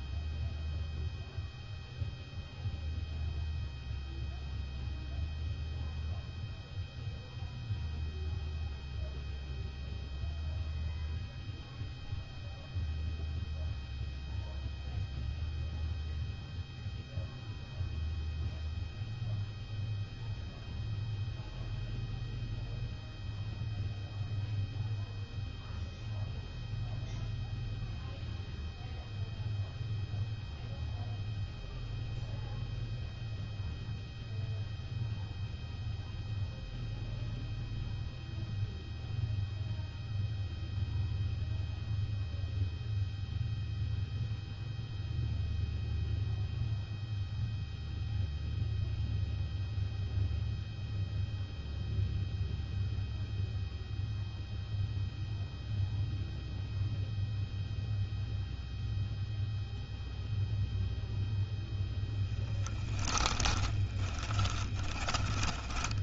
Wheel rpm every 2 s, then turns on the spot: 0, 0, 0, 0, 0, 0, 0, 0, 0, 0, 0, 0, 0, 0, 0, 0, 0, 0, 0, 0, 0, 0, 0, 0, 0, 0, 0, 0, 0, 0, 0, 10, 20.
62-66